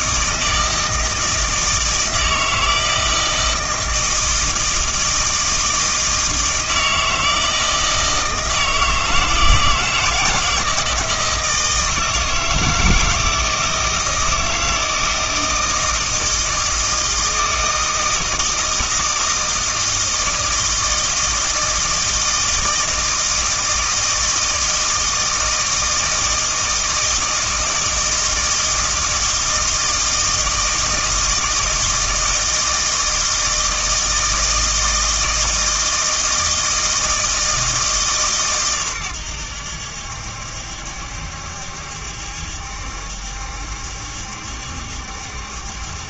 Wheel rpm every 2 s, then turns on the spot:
160, 160, 160, 160, 160, 160, 160, 160, 160, 160, 160, 160, 160, 160, 160, 160, 160, 160, 160, 130, 70, 70, 70.
none